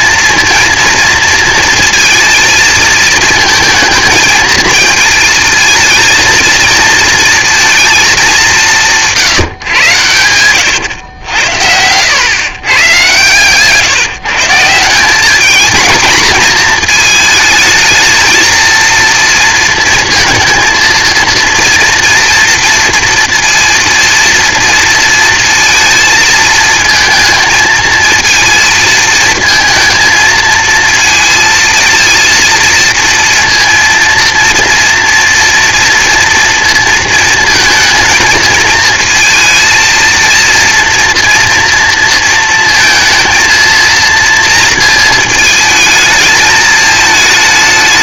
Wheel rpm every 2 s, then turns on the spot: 230, 230, 220, 230, 180, 110, 130, 170, 220, 230, 230, 230, 230, 220, 220, 230, 230, 230, 230, 220, 230, 230, 230, 220.
none